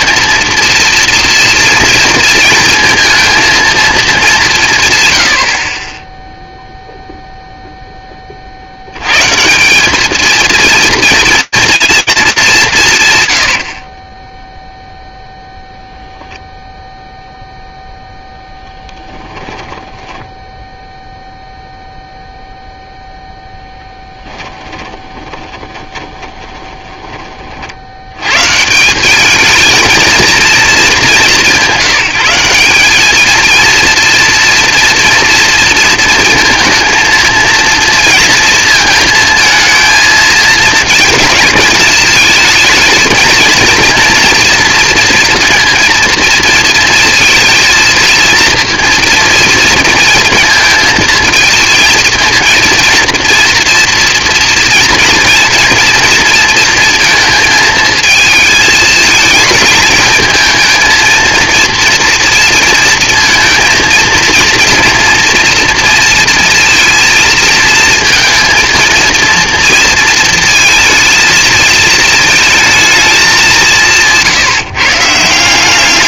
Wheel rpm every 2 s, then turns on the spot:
230, 230, 110, 0, 90, 230, 110, 0, 0, 10, 0, 0, 20, 20, 180, 210, 200, 230, 230, 230, 220, 220, 230, 230, 230, 230, 230, 230, 230, 220, 220, 230, 230, 230, 230, 220, 220, 160.
18-20 24-26